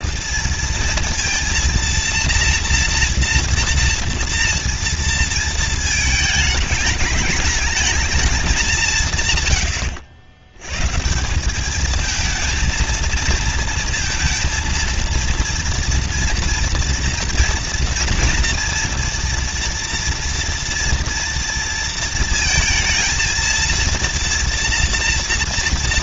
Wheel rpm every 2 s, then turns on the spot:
230, 240, 230, 210, 190, 100, 230, 230, 230, 230, 230, 230, 230.
none